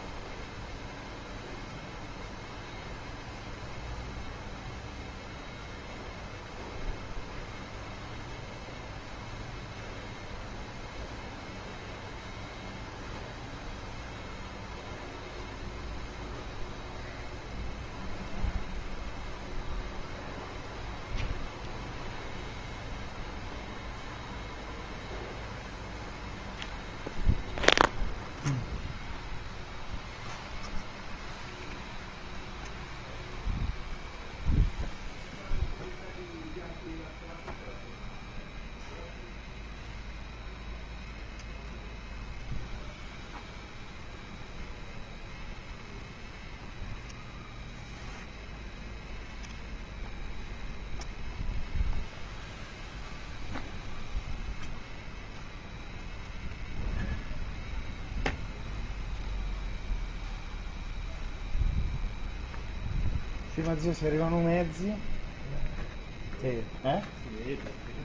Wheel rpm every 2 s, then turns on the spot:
0, 0, 0, 0, 0, 0, 0, 0, 0, 0, 0, 0, 0, 0, 0, 0, 0, 0, 0, 0, 0, 0, 0, 0, 0, 0, 0, 0, 0, 0, 0, 0, 0, 0.
none